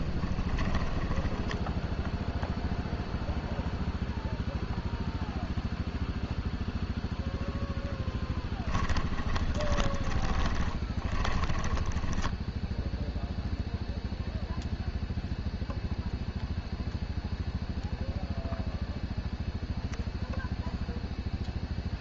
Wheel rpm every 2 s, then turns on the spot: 10, 0, 0, 0, 10, 20, 0, 0, 0, 0, 0.
0-2 10-12